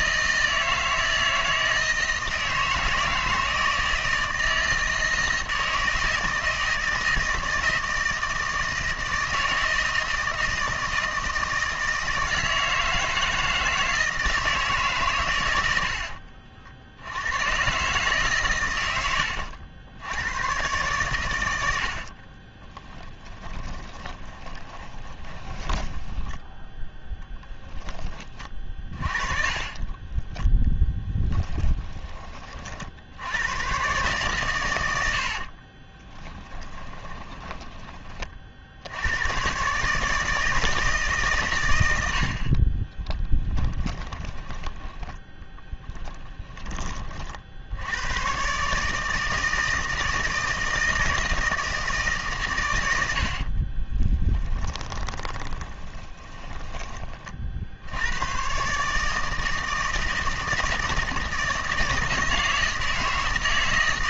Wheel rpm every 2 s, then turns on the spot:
160, 160, 160, 160, 160, 160, 160, 140, 70, 110, 110, 30, 30, 10, 40, 20, 60, 100, 10, 80, 160, 30, 10, 30, 140, 160, 100, 30, 20, 140, 160, 160.
22-26 28-32 36-38 42-44 54-56